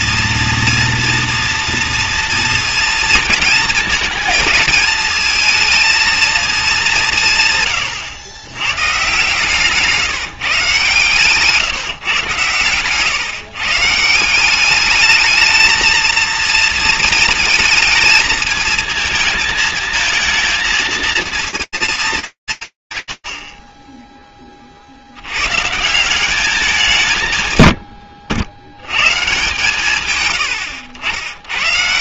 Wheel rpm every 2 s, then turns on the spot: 230, 230, 220, 210, 110, 140, 120, 190, 230, 220, 220, 160, 30, 190, 100, 90.
none